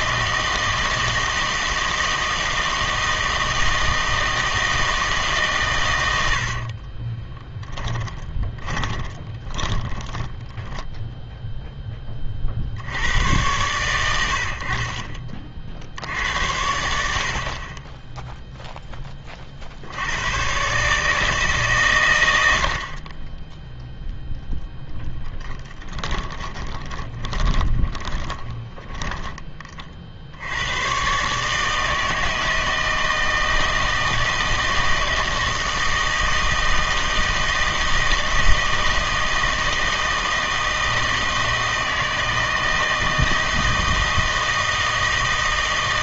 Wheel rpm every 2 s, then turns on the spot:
160, 160, 160, 40, 10, 0, 70, 50, 80, 0, 130, 80, 10, 20, 10, 100, 160, 160, 160, 160, 160, 160, 160.
6-10 26-30